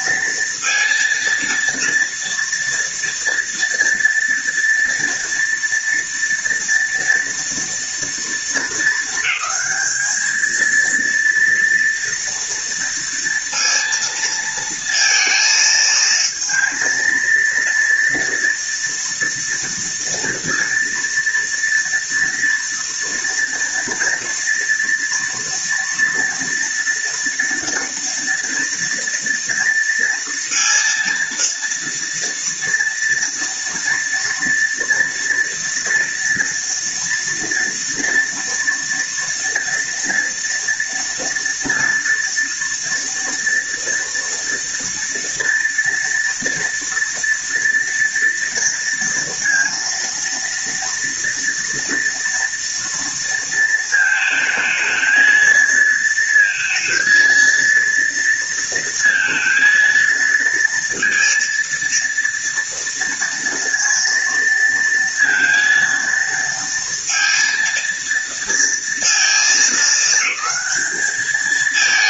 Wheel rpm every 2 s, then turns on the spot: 230, 230, 230, 230, 220, 230, 230, 230, 230, 230, 230, 230, 240, 230, 230, 230, 230, 230, 230, 240, 230, 230, 230, 230, 230, 230, 230, 220, 230, 230, 230, 230, 230, 230, 230, 210.
none